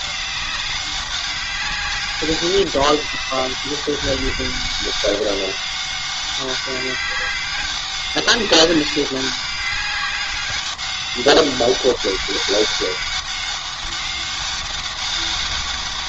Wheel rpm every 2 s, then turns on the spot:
190, 200, 200, 200, 200, 200, 200, 200.
none